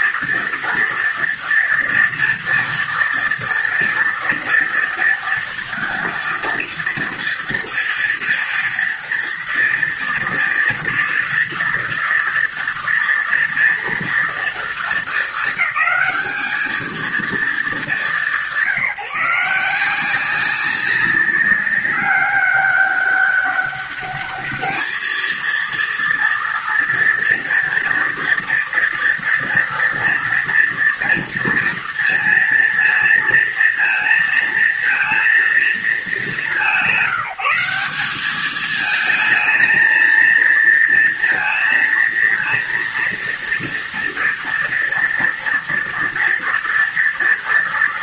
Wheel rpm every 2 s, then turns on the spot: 230, 240, 230, 230, 230, 230, 230, 210, 230, 170, 200, 200, 220, 230, 230, 230, 230, 230, 190, 220, 230, 230, 230, 230.
none